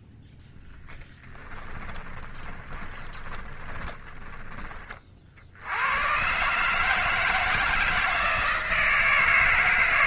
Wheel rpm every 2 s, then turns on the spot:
10, 20, 20, 140, 160.
0-4